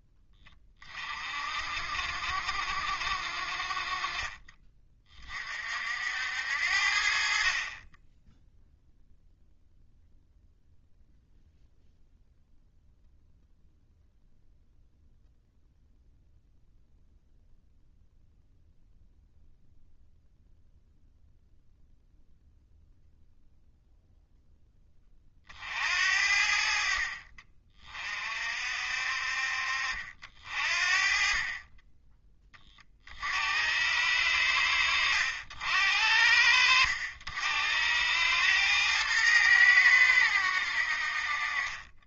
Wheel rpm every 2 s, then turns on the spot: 30, 60, 30, 70, 0, 0, 0, 0, 0, 0, 0, 0, 10, 60, 50, 40, 30, 80, 70, 110, 70.
none